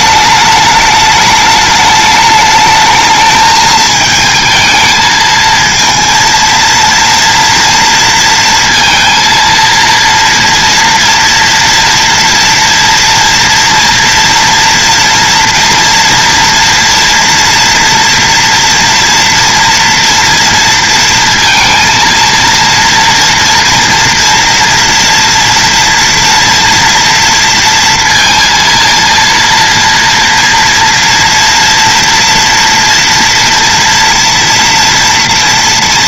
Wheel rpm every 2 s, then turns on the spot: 210, 220, 220, 230, 230, 230, 240, 230, 230, 230, 230, 230, 230, 230, 230, 230, 230, 230.
none